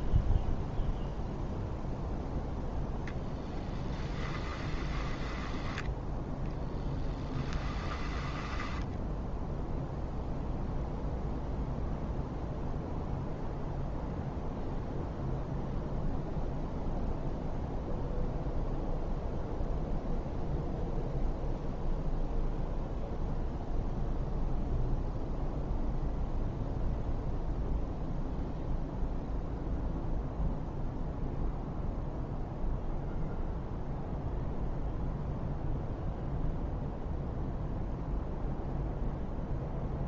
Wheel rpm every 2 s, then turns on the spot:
0, 0, 10, 10, 10, 0, 0, 0, 0, 0, 0, 0, 0, 0, 0, 0, 0, 0, 0, 0.
4-10